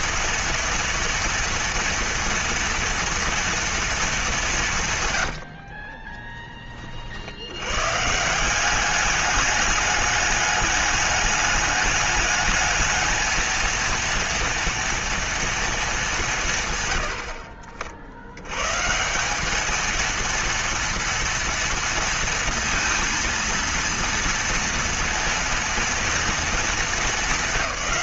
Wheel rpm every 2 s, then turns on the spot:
230, 240, 180, 30, 170, 210, 210, 230, 150, 100, 230, 230, 230, 230.
none